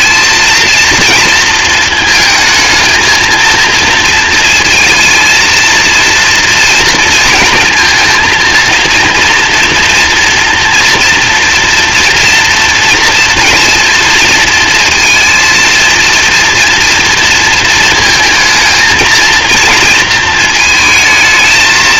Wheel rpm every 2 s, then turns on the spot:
230, 220, 230, 230, 230, 230, 230, 230, 230, 230, 220.
none